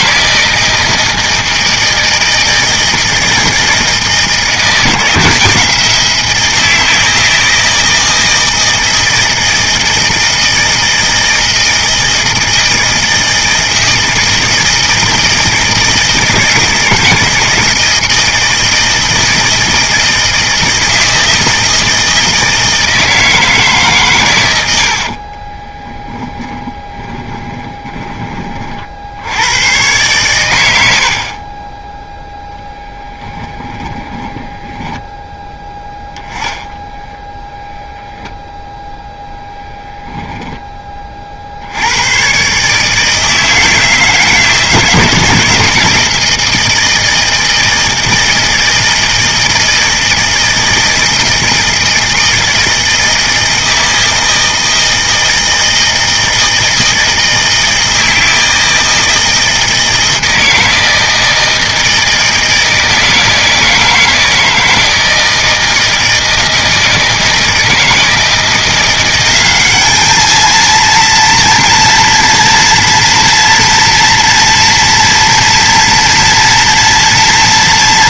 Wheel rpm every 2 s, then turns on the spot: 160, 160, 160, 170, 160, 160, 160, 160, 160, 160, 160, 160, 90, 20, 50, 90, 0, 10, 0, 0, 20, 140, 160, 160, 160, 160, 160, 160, 160, 160, 160, 160, 160, 160, 170, 220, 230, 230, 230.
26-28 34-36